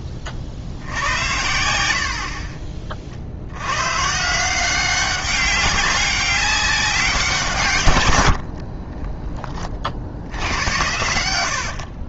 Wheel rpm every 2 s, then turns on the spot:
70, 40, 180, 190, 50, 90.
8-12